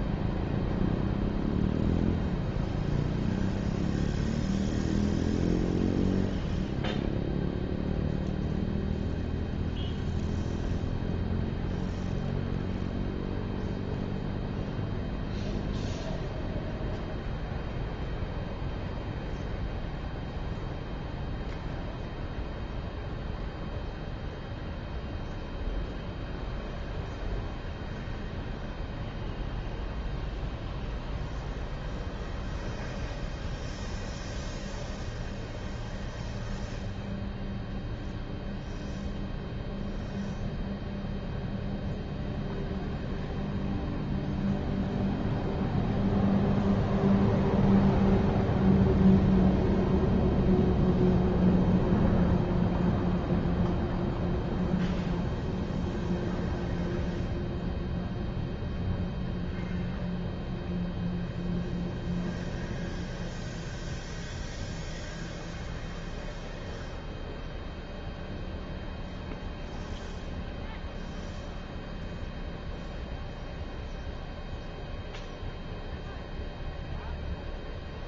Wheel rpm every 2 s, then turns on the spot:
0, 0, 0, 0, 0, 0, 0, 0, 0, 0, 0, 0, 0, 0, 0, 0, 0, 0, 0, 0, 0, 0, 0, 0, 0, 0, 0, 0, 0, 0, 0, 0, 0, 0, 0, 0, 0, 0, 0.
none